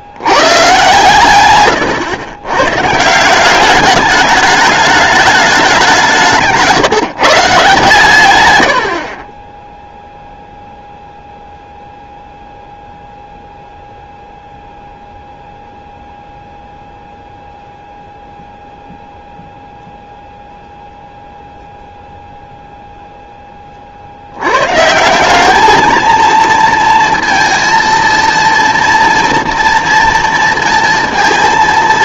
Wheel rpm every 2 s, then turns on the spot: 120, 120, 210, 150, 90, 0, 0, 0, 0, 0, 0, 0, 110, 230, 230, 230.
none